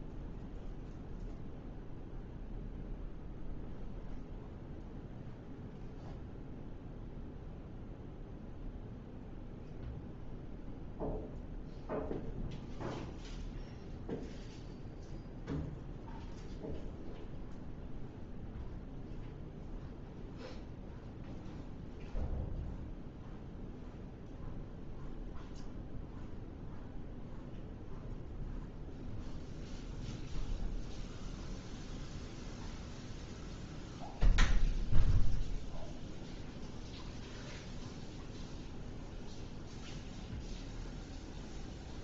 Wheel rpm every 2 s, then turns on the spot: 0, 0, 0, 0, 0, 0, 0, 0, 0, 0, 0, 0, 0, 0, 0, 0, 0, 0, 0, 0, 0.
none